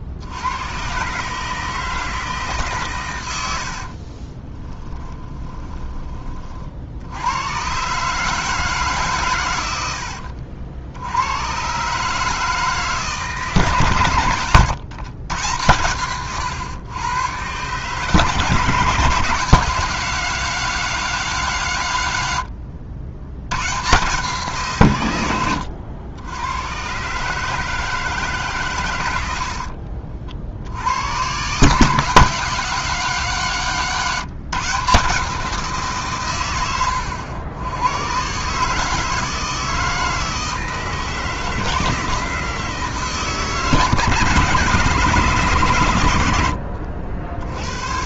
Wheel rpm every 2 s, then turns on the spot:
120, 140, 10, 70, 150, 80, 160, 120, 120, 160, 190, 100, 140, 120, 110, 90, 190, 160, 110, 150, 160, 160, 160, 70.
4-6 46-48